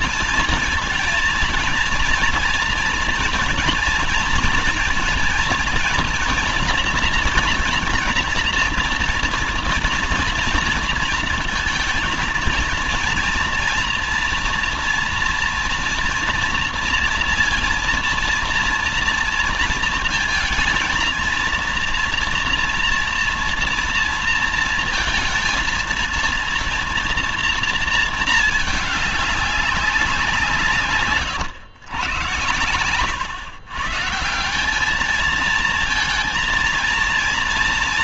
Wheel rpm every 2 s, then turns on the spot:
230, 230, 230, 230, 230, 230, 230, 230, 230, 230, 220, 230, 230, 230, 210, 150, 110, 200, 230.
none